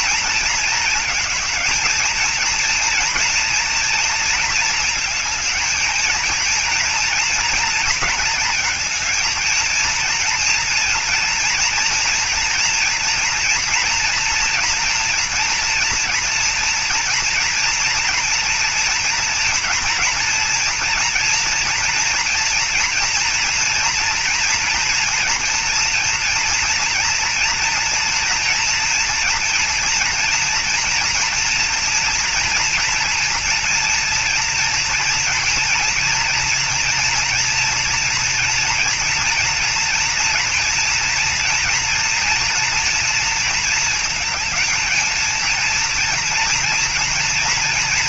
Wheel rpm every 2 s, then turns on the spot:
230, 220, 230, 220, 220, 230, 240, 240, 230, 240, 230, 230, 240, 230, 230, 230, 230, 230, 240, 230, 230, 230, 220, 230.
none